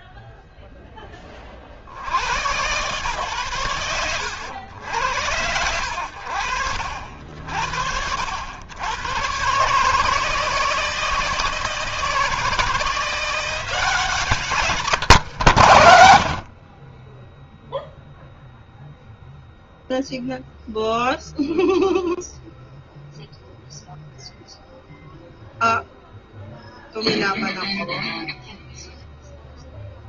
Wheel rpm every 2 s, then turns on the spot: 100, 90, 80, 90, 160, 170, 150, 60, 0, 0, 0, 0, 0, 0, 0.
12-14